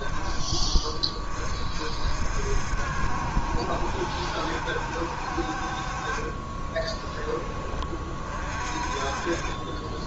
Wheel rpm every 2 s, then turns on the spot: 20, 60, 60, 10, 40.
6-10